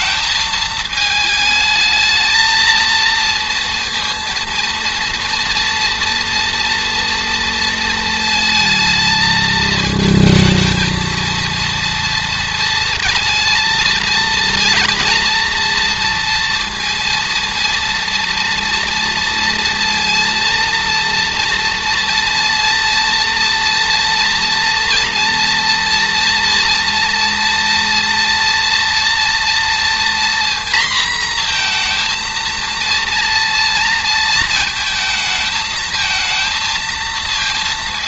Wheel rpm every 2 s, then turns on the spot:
220, 220, 230, 230, 220, 230, 230, 230, 230, 230, 230, 230, 230, 230, 230, 240, 230, 230, 230.
none